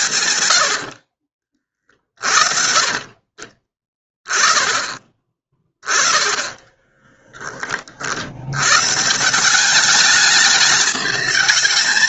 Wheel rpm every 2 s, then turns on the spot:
30, 30, 20, 10, 190, 210.
0-2